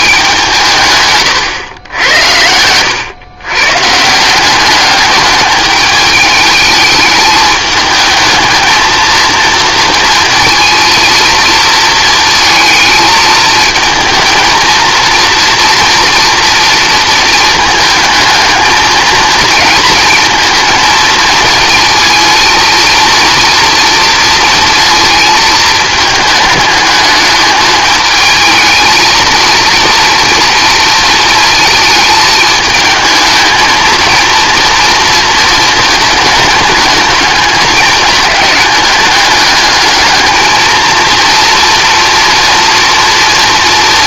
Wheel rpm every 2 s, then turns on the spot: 160, 90, 190, 210, 220, 230, 220, 230, 230, 220, 230, 230, 230, 220, 220, 230, 220, 230, 210, 210, 220, 230.
2-4